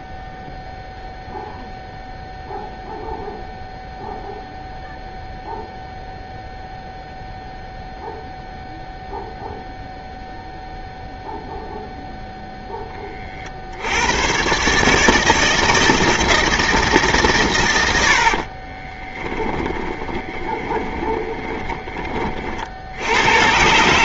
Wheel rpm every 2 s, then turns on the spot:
0, 0, 0, 0, 0, 0, 90, 160, 90, 10, 20, 130.
16-20